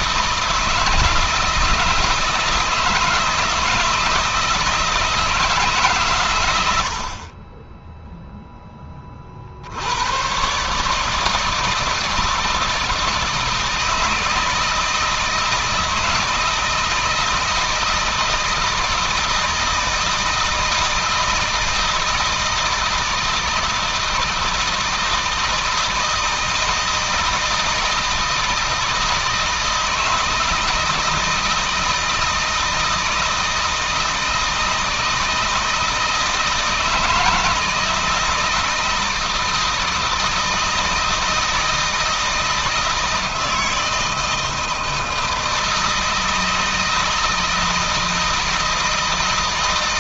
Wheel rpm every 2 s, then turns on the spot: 160, 160, 160, 100, 10, 140, 160, 160, 160, 160, 160, 160, 160, 160, 160, 160, 160, 160, 160, 160, 160, 160, 160, 160, 160.
none